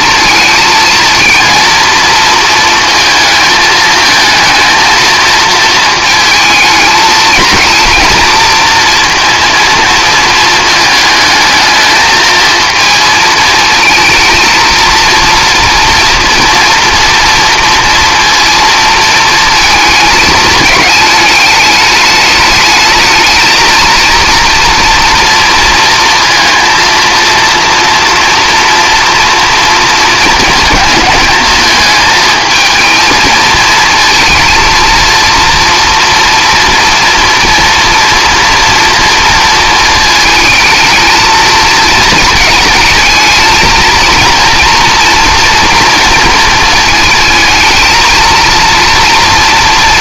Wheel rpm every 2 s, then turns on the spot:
220, 230, 230, 220, 230, 220, 220, 230, 230, 230, 210, 210, 240, 230, 230, 220, 220, 230, 230, 230, 220, 220, 230, 220, 230.
none